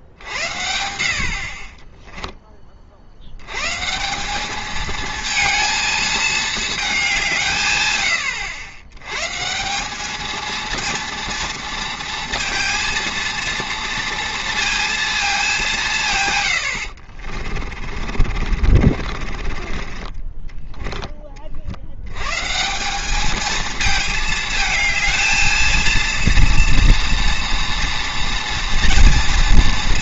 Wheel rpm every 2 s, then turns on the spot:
70, 30, 210, 220, 100, 220, 230, 230, 100, 50, 10, 180, 220, 230, 230.
18-20